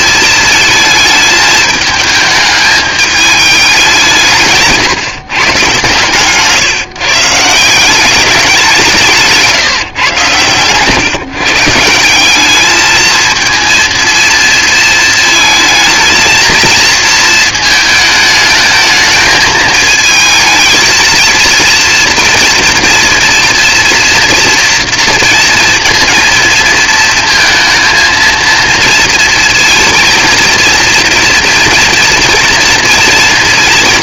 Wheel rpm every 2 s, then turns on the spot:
220, 210, 150, 140, 180, 130, 210, 230, 230, 220, 220, 230, 230, 230, 230, 230, 240.
none